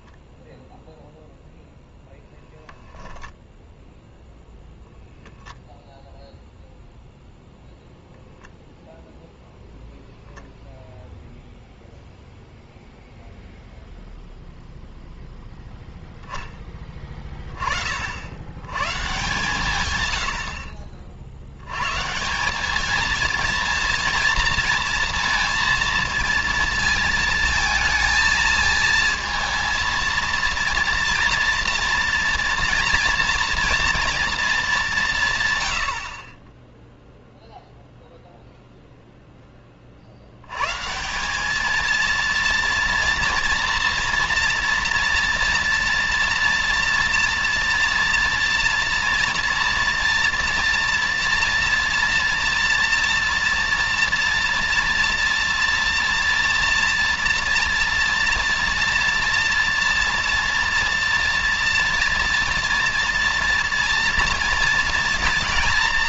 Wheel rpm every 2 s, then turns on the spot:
0, 0, 0, 0, 0, 0, 0, 0, 20, 150, 50, 220, 230, 220, 230, 230, 240, 180, 0, 0, 130, 230, 240, 230, 230, 230, 230, 230, 230, 230, 230, 230, 230.
none